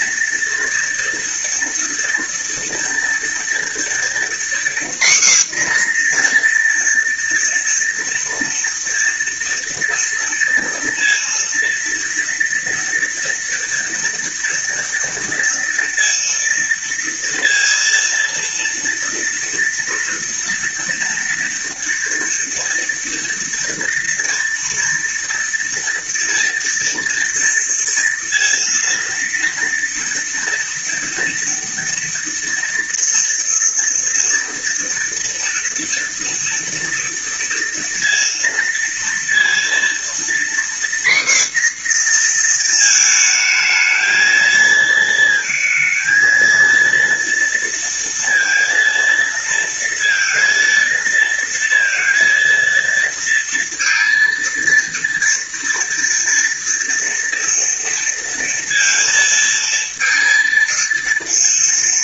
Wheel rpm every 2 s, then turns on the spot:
230, 230, 250, 240, 230, 230, 230, 230, 230, 230, 230, 230, 230, 230, 230, 230, 230, 230, 230, 230, 240, 220, 220, 230, 230, 230, 230, 230, 230, 230, 230.
none